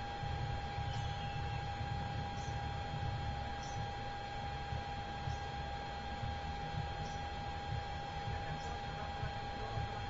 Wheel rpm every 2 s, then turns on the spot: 0, 0, 0, 0, 0.
none